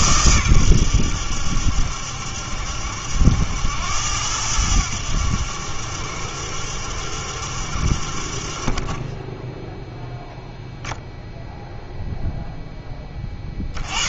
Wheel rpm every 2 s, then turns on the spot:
100, 70, 90, 70, 30, 0, 10.
none